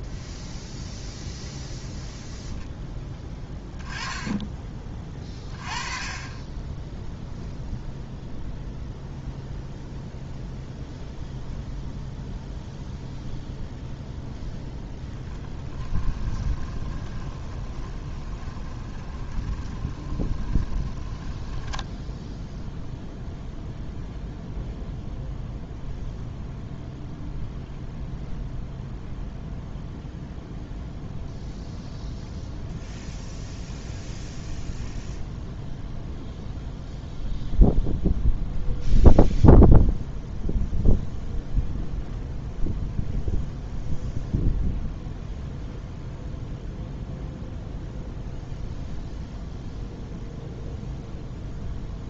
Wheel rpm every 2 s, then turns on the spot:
0, 0, 20, 20, 0, 0, 0, 0, 20, 20, 20, 0, 0, 0, 0, 0, 0, 0, 0, 0, 0, 0, 0, 0, 0, 0.
16-22